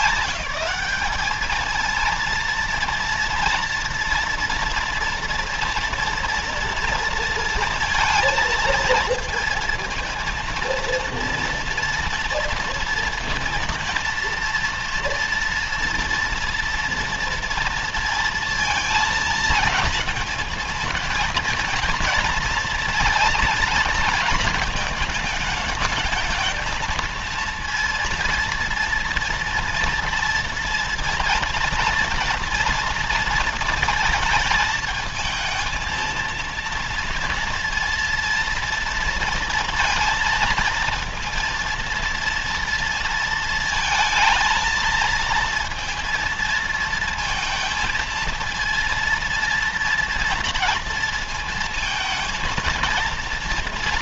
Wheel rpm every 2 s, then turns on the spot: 210, 230, 230, 230, 220, 230, 230, 230, 230, 230, 220, 230, 220, 230, 240, 230, 230, 220, 230, 230, 230, 230, 230, 230, 230, 230, 230.
none